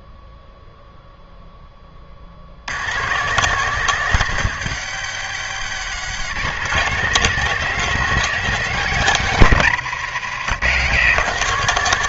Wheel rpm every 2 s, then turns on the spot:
0, 110, 120, 170, 170, 120.
none